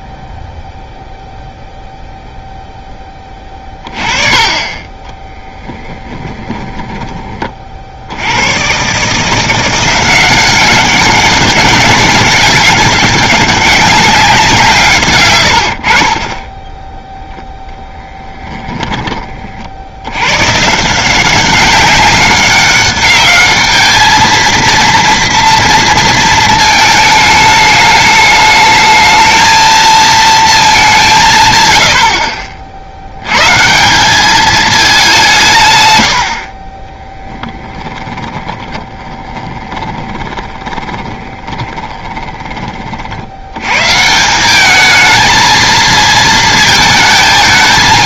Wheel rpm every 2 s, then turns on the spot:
0, 10, 20, 20, 130, 190, 200, 150, 10, 10, 150, 200, 230, 220, 220, 200, 50, 210, 20, 10, 20, 30, 210, 220.
4-8 38-42